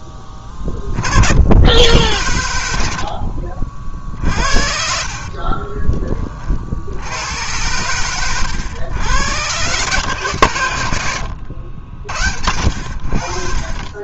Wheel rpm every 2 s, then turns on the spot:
40, 50, 60, 80, 110, 100, 100.
4-6 10-12